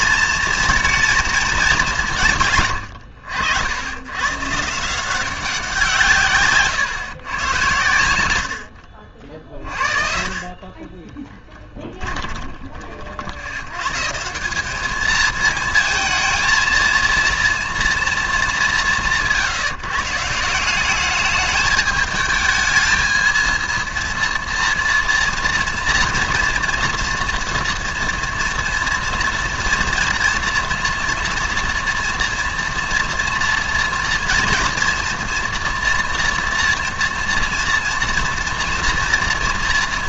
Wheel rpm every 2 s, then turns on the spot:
230, 140, 140, 150, 90, 40, 20, 190, 230, 200, 180, 220, 230, 230, 230, 230, 230, 230, 230, 240.
none